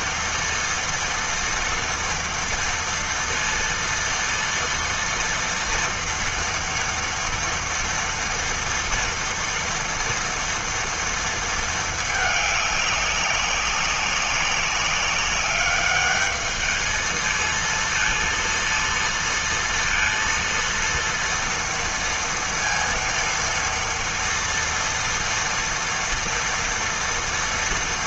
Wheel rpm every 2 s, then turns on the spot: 230, 230, 230, 230, 230, 230, 210, 200, 210, 230, 230, 230, 230, 230.
none